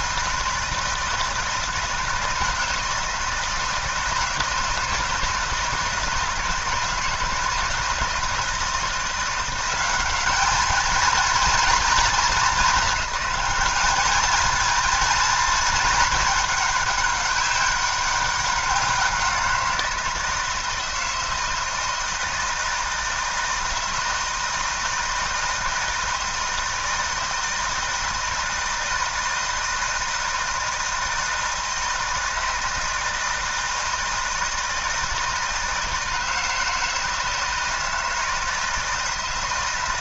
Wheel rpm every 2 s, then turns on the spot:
160, 160, 160, 160, 170, 210, 210, 220, 210, 190, 160, 160, 160, 160, 160, 160, 160, 160, 160, 160.
none